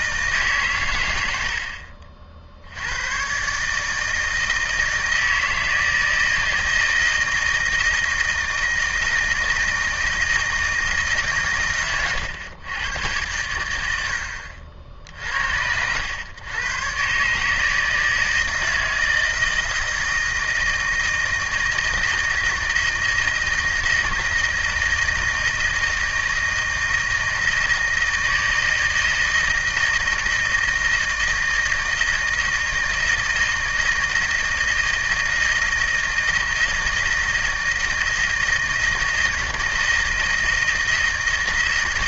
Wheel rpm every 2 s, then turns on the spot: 140, 70, 160, 160, 160, 160, 110, 60, 110, 160, 160, 160, 160, 160, 160, 160, 160, 160, 160, 160, 160.
none